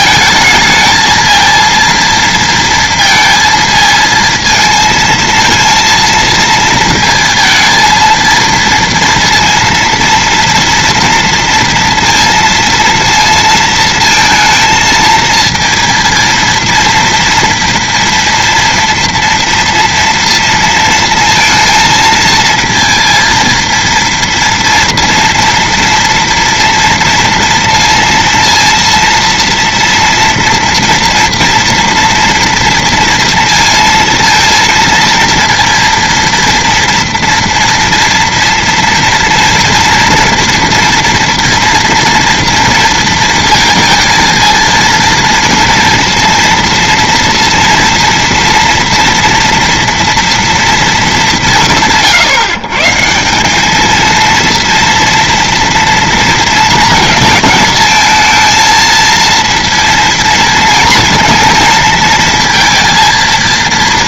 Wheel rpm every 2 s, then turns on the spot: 220, 230, 220, 220, 230, 230, 230, 230, 230, 230, 230, 230, 240, 230, 230, 230, 230, 230, 230, 230, 240, 230, 230, 230, 230, 230, 150, 230, 220, 230, 230, 230.
none